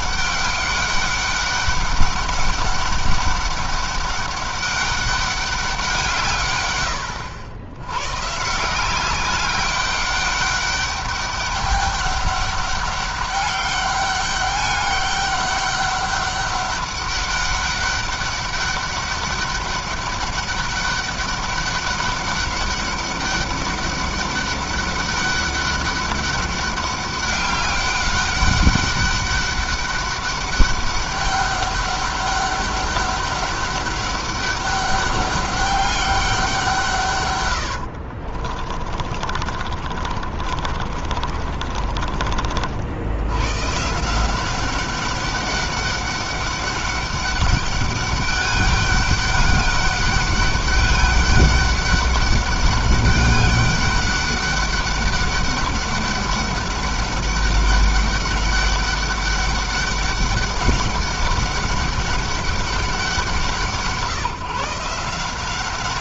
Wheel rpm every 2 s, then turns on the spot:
200, 200, 200, 100, 180, 200, 200, 200, 200, 200, 200, 200, 200, 200, 200, 200, 200, 200, 160, 40, 40, 60, 190, 200, 200, 200, 200, 200, 200, 200, 200, 200, 170.
38-42